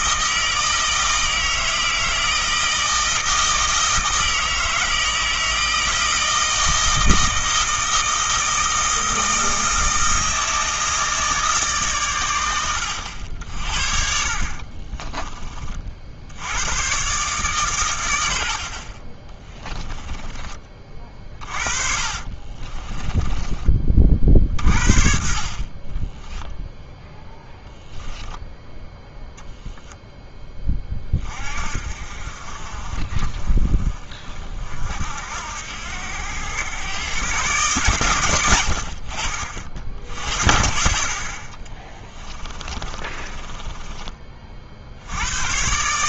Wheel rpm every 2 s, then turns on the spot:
160, 160, 160, 160, 160, 160, 80, 30, 130, 30, 40, 20, 50, 0, 0, 30, 40, 60, 120, 70, 50, 30, 70.
14-16 20-24 42-44